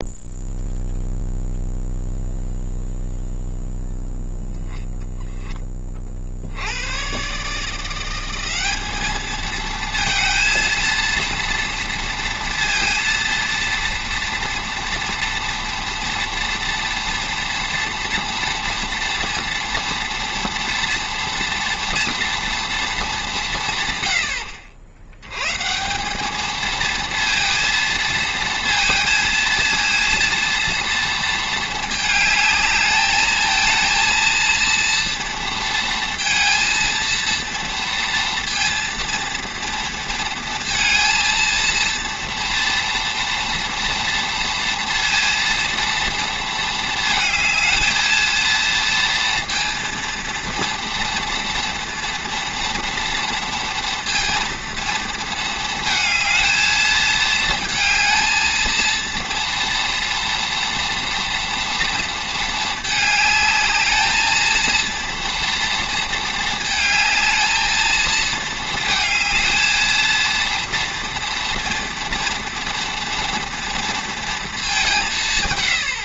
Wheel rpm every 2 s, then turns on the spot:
0, 0, 0, 100, 200, 230, 230, 230, 230, 230, 230, 220, 70, 220, 230, 230, 220, 230, 230, 230, 230, 230, 230, 220, 230, 230, 240, 230, 220, 230, 230, 220, 230, 220, 220, 230, 230, 210.
none